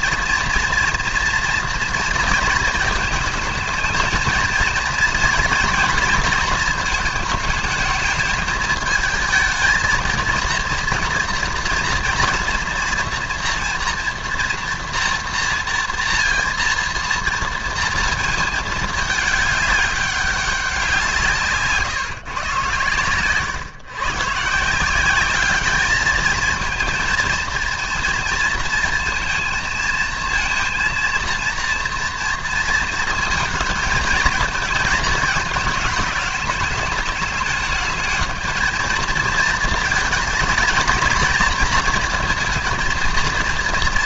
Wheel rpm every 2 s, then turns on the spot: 230, 230, 240, 230, 220, 230, 230, 230, 230, 210, 180, 130, 160, 230, 230, 230, 230, 220, 210, 220, 220, 230.
none